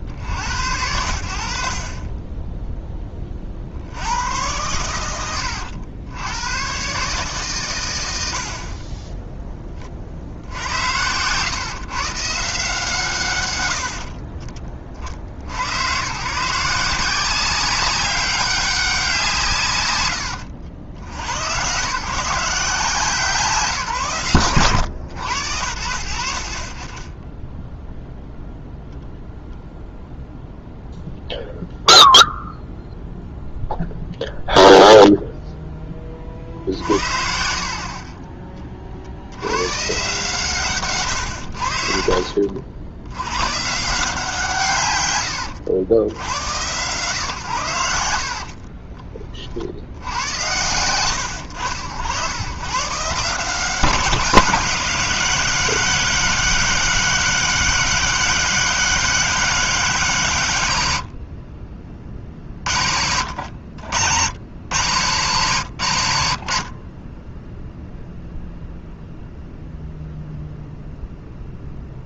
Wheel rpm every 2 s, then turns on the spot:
80, 10, 100, 130, 40, 80, 150, 40, 170, 190, 80, 160, 100, 30, 0, 0, 0, 0, 60, 40, 120, 80, 140, 120, 40, 100, 140, 180, 190, 190, 80, 60, 120, 50, 0, 0.
48-50 62-64 66-68